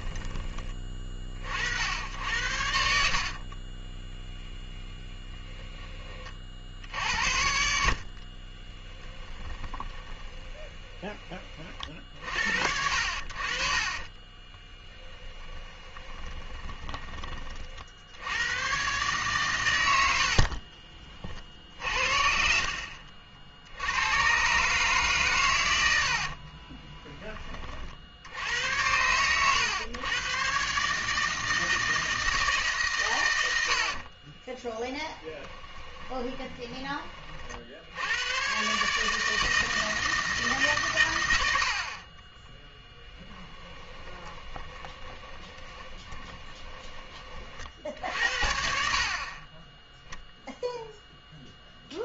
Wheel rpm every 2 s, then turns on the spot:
20, 70, 20, 60, 30, 20, 60, 20, 20, 120, 40, 70, 140, 30, 90, 140, 140, 20, 20, 140, 140, 10, 20, 20, 50, 0.
4-6 8-12 14-18 20-22 26-28 34-36 42-46